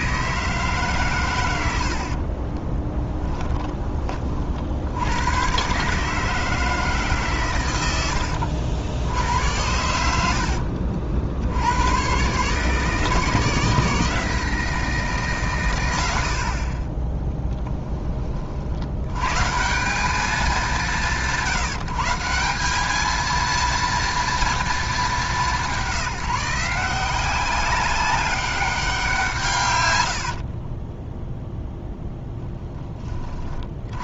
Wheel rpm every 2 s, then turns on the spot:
150, 20, 70, 150, 80, 70, 150, 170, 10, 80, 190, 200, 220, 170, 190, 20, 10.
2-4 30-32